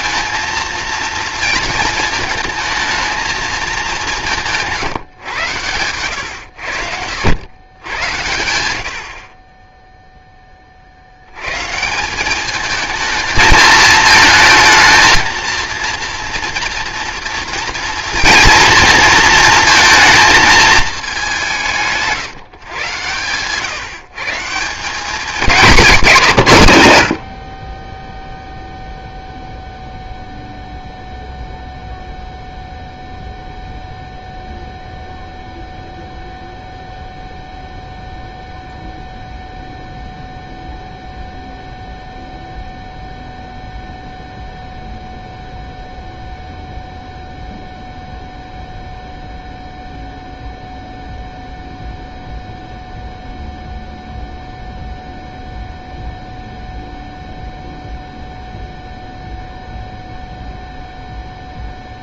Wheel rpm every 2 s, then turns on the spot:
230, 220, 150, 80, 70, 60, 220, 220, 230, 230, 210, 120, 180, 110, 0, 0, 0, 0, 0, 0, 0, 0, 0, 0, 0, 0, 0, 0, 0, 0, 0.
none